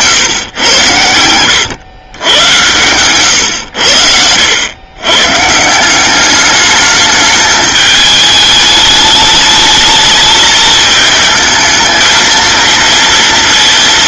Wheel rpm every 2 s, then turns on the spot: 110, 110, 100, 210, 210, 220, 230.
none